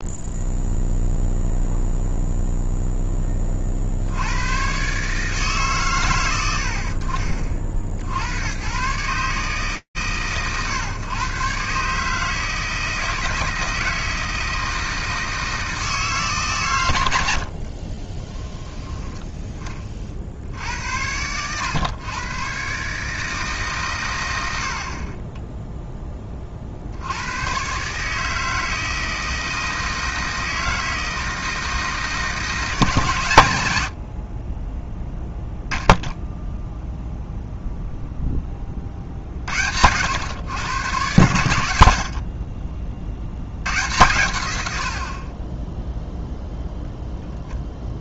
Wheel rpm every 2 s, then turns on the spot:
0, 0, 110, 90, 90, 120, 160, 160, 100, 10, 90, 150, 20, 90, 160, 160, 130, 10, 0, 50, 120, 60, 60, 10.
none